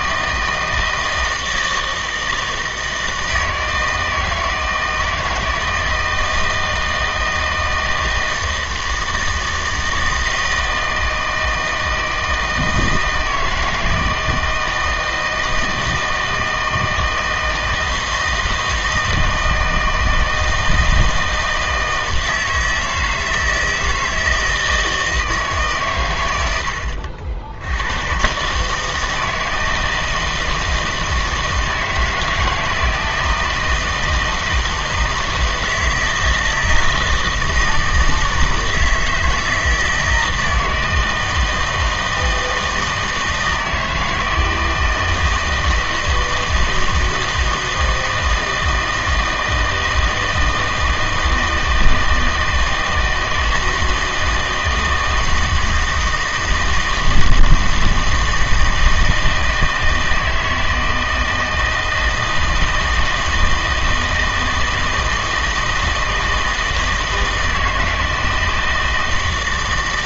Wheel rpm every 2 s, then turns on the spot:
160, 160, 160, 160, 160, 160, 160, 160, 160, 160, 160, 160, 160, 80, 150, 160, 160, 160, 160, 160, 170, 160, 160, 160, 160, 160, 160, 160, 160, 160, 160, 160, 160, 160, 160.
none